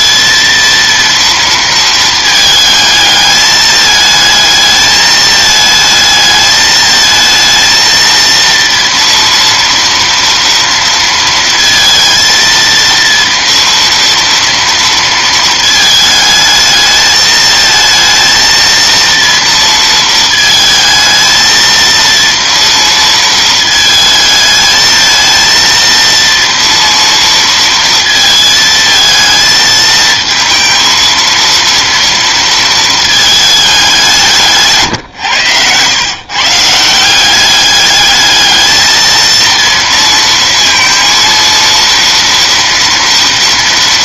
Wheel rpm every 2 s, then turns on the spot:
230, 220, 220, 220, 230, 230, 230, 230, 220, 230, 220, 230, 220, 230, 220, 230, 220, 140, 160, 220, 230, 240.
34-36